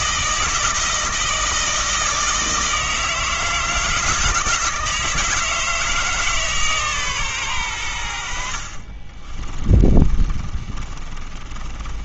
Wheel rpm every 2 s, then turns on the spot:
160, 160, 160, 150, 40, 30.
8-12